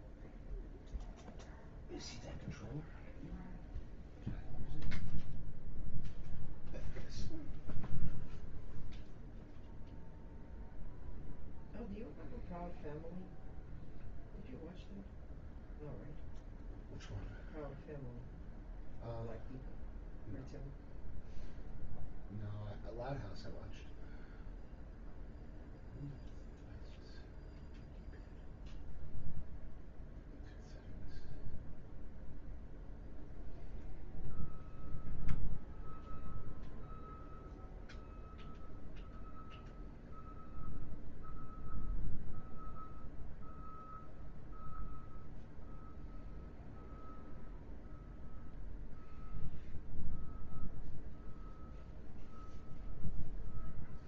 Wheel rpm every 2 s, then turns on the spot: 0, 0, 0, 0, 0, 0, 0, 0, 0, 0, 0, 0, 0, 0, 0, 0, 0, 0, 0, 0, 0, 0, 0, 0, 0, 0, 0.
none